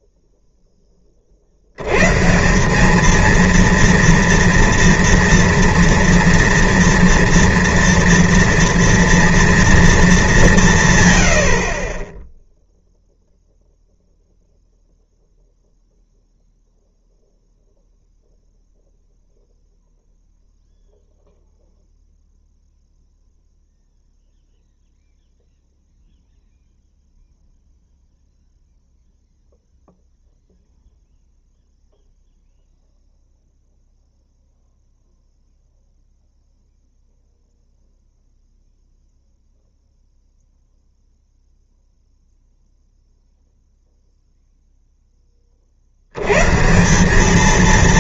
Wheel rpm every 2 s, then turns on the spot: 10, 180, 230, 230, 230, 180, 10, 0, 0, 0, 0, 0, 0, 0, 0, 0, 0, 0, 0, 0, 0, 0, 0, 140.
none